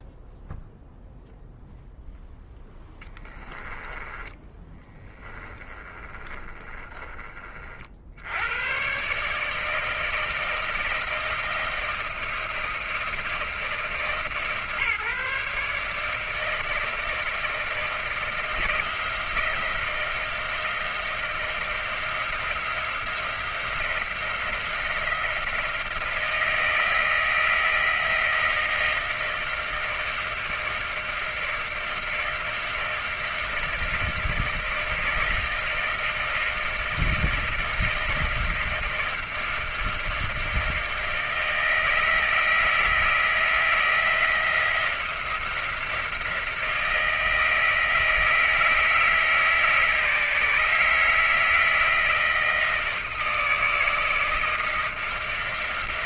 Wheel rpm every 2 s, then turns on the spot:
0, 0, 10, 20, 60, 160, 160, 150, 160, 160, 160, 160, 170, 160, 160, 160, 160, 160, 160, 160, 160, 160, 160, 170, 160, 150, 160, 160.
4-8